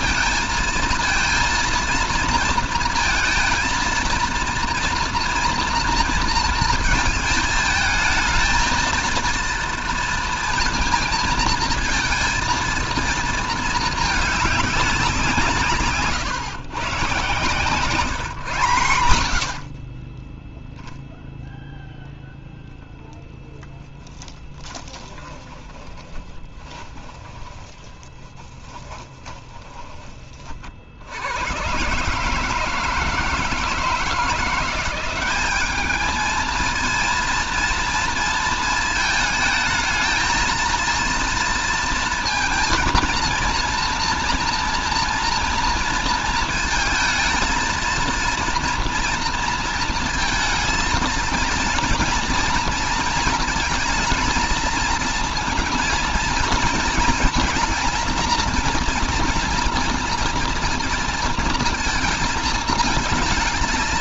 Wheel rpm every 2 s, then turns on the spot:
220, 230, 240, 230, 230, 230, 230, 190, 130, 120, 0, 0, 20, 20, 30, 50, 150, 180, 230, 220, 230, 230, 230, 220, 230, 220, 230, 230, 230, 230, 230, 220.
24-30